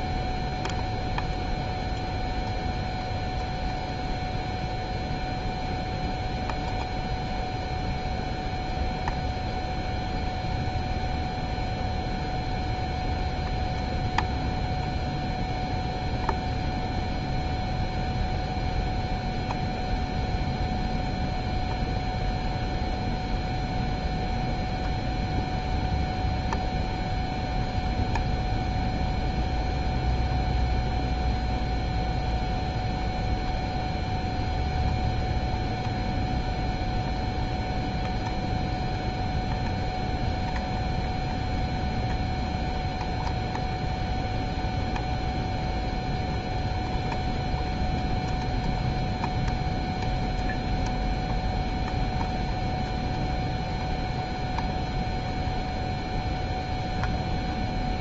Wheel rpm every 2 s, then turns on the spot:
0, 0, 0, 0, 0, 0, 0, 0, 0, 0, 0, 0, 0, 0, 0, 0, 0, 0, 0, 0, 0, 0, 0, 0, 0, 0, 0, 0, 0.
none